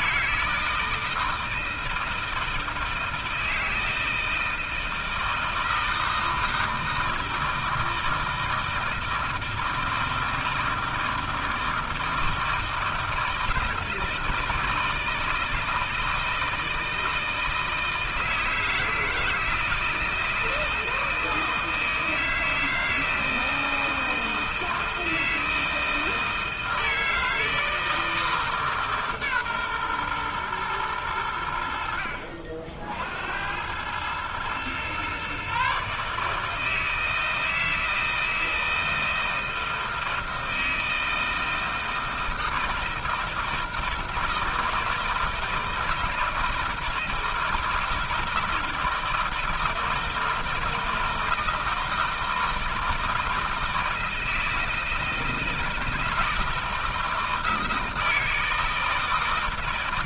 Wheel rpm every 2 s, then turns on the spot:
160, 160, 160, 160, 160, 160, 160, 160, 160, 160, 160, 160, 160, 160, 150, 120, 60, 120, 160, 160, 160, 160, 160, 160, 160, 160, 160, 160, 160, 160.
none